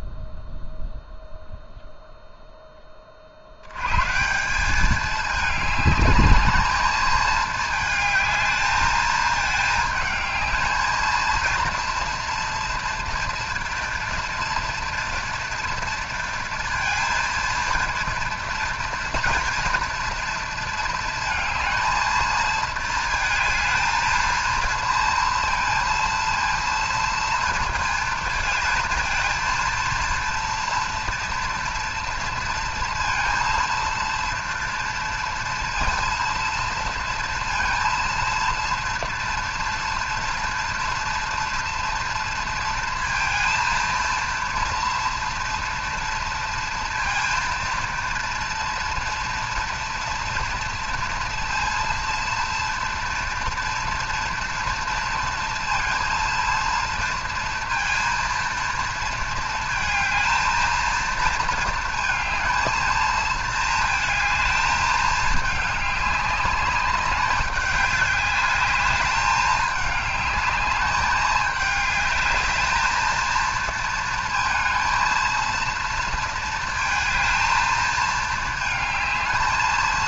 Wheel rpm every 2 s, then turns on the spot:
0, 30, 210, 220, 220, 230, 240, 230, 230, 240, 220, 230, 230, 230, 220, 240, 230, 230, 230, 230, 230, 230, 230, 230, 230, 230, 230, 230, 230, 230, 230, 220, 220, 200, 200, 210, 220, 230, 220, 220.
none